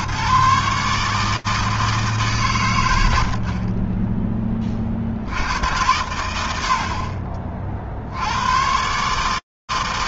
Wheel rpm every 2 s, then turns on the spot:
120, 160, 10, 100, 40.
none